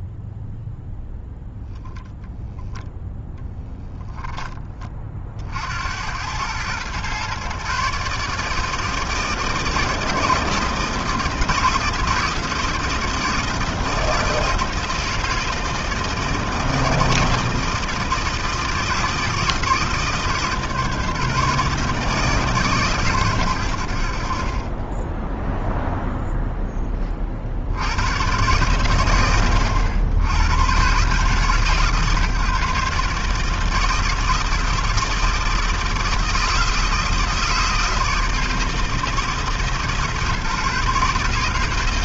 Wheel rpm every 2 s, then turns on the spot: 0, 10, 110, 150, 160, 160, 160, 160, 160, 150, 150, 50, 0, 110, 90, 140, 160, 160, 160, 150, 160.
none